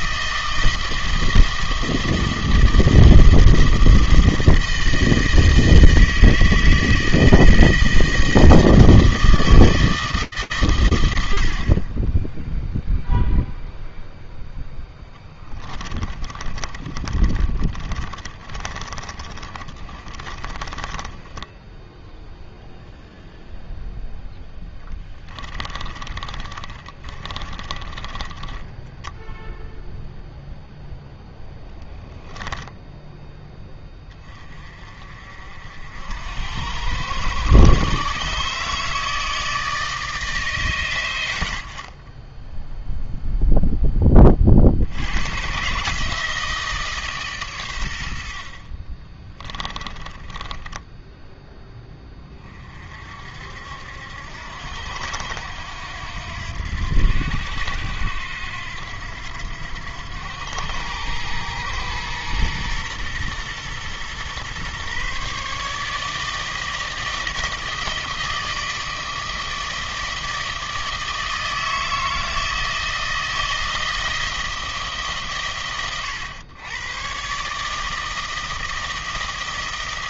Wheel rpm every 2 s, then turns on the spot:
160, 160, 160, 160, 160, 130, 0, 0, 20, 20, 20, 0, 10, 20, 0, 10, 10, 50, 110, 160, 100, 0, 80, 150, 30, 10, 40, 80, 90, 90, 100, 120, 130, 160, 160, 160, 160, 160, 100, 160.
16-22 24-28 48-52